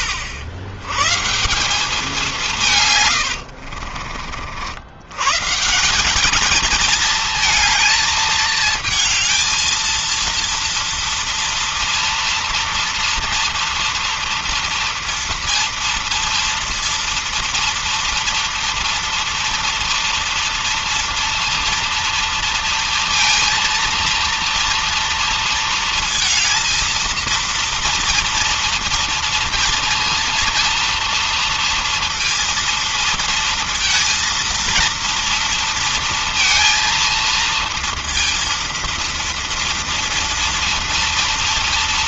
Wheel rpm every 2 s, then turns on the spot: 100, 170, 60, 210, 220, 230, 230, 230, 230, 230, 230, 230, 230, 230, 230, 230, 230, 230, 230, 230, 230.
none